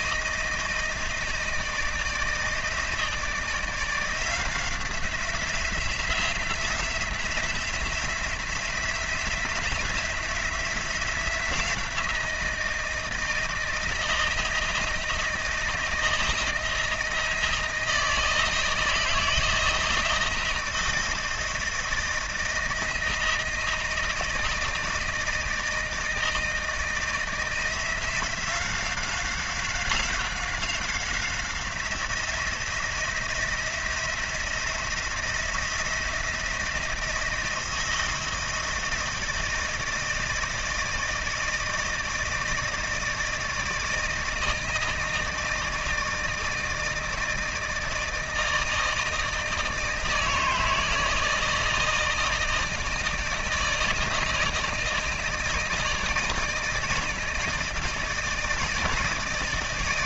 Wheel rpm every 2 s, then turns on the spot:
160, 160, 170, 170, 180, 180, 170, 160, 160, 160, 160, 160, 160, 160, 180, 180, 170, 170, 170, 160, 160, 160, 160, 160, 160, 160, 160, 160, 160, 160.
none